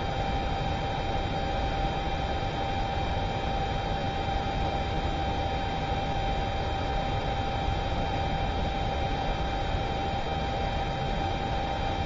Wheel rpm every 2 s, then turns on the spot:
0, 0, 0, 0, 0, 0.
none